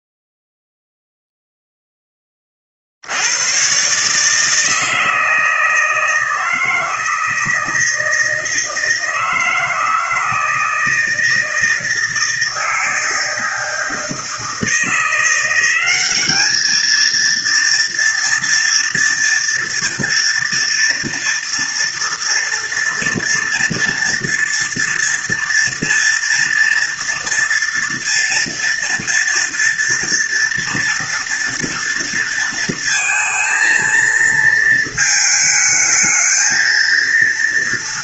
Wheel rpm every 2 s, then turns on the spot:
0, 20, 150, 160, 160, 160, 160, 160, 210, 230, 230, 230, 230, 230, 230, 230, 230, 230, 220.
none